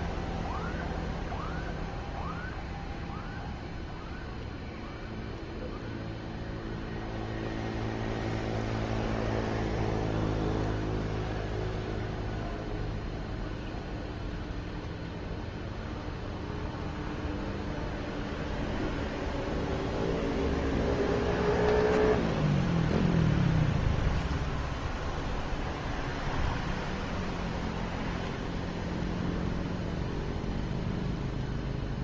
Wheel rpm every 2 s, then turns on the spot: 0, 0, 0, 0, 0, 0, 0, 0, 0, 0, 0, 0, 0, 0, 0, 0.
none